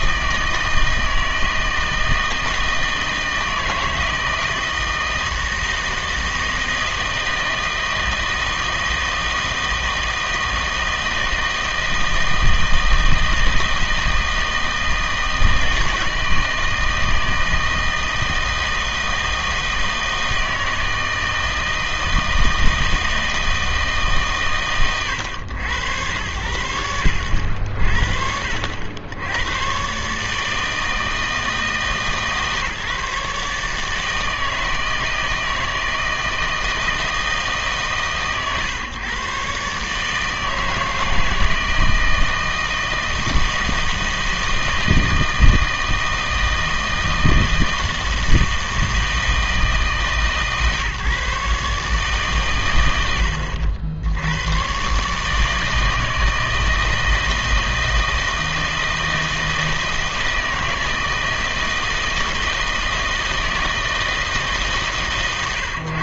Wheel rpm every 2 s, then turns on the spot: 160, 160, 160, 160, 160, 160, 160, 160, 160, 160, 160, 160, 120, 90, 70, 160, 150, 160, 160, 130, 160, 160, 160, 160, 160, 150, 100, 120, 160, 160, 160, 160, 150.
none